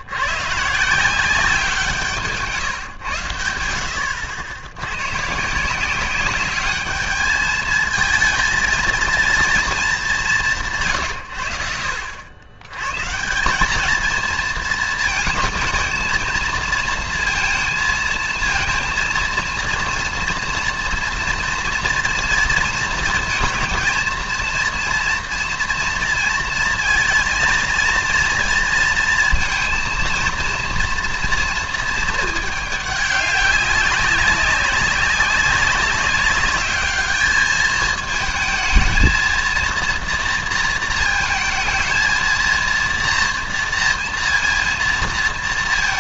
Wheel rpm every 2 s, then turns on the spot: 140, 150, 90, 210, 220, 170, 110, 220, 230, 230, 230, 230, 230, 230, 230, 230, 210, 190, 210, 220, 230, 230, 230.
none